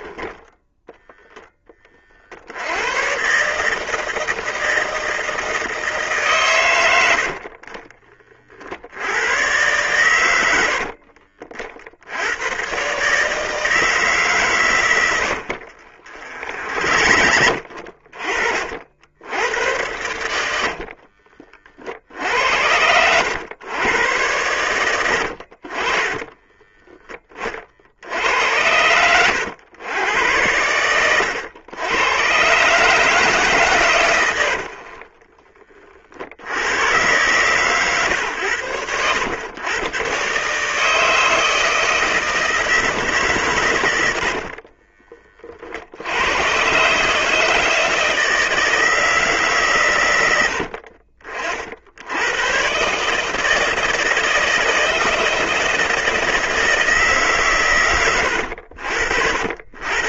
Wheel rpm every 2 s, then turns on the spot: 0, 120, 160, 100, 90, 50, 140, 100, 60, 80, 50, 90, 90, 20, 90, 100, 150, 40, 110, 100, 160, 140, 30, 140, 160, 60, 150, 160, 150, 70.
14-16 20-22 24-26 34-36